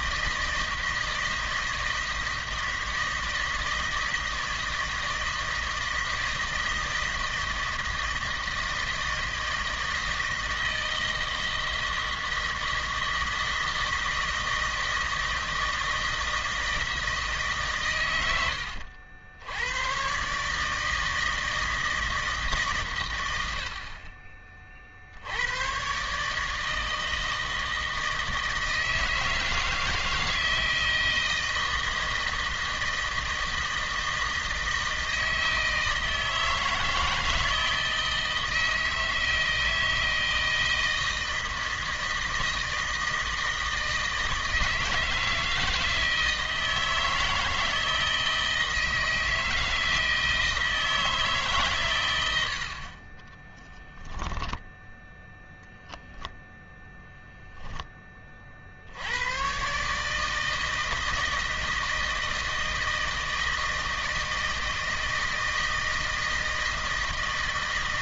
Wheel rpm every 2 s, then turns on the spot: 160, 160, 160, 160, 160, 160, 160, 160, 160, 80, 160, 130, 50, 160, 160, 160, 160, 160, 160, 160, 160, 160, 160, 160, 160, 160, 50, 10, 0, 60, 160, 160, 160, 160.
52-56